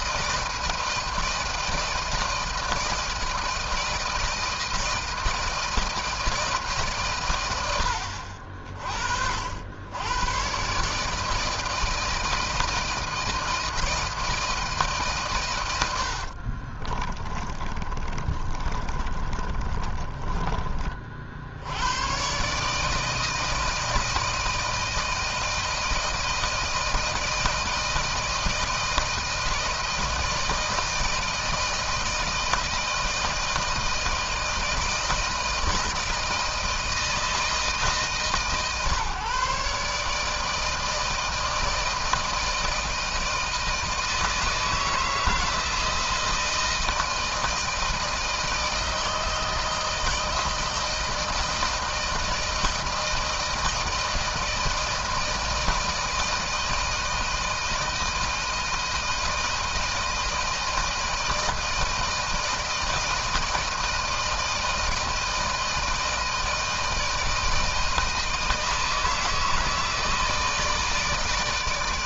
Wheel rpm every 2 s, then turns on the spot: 160, 170, 160, 160, 60, 100, 160, 160, 70, 30, 20, 120, 160, 160, 160, 160, 160, 160, 160, 140, 150, 160, 160, 160, 160, 160, 160, 160, 160, 160, 160, 160, 160, 160, 160, 160.
16-22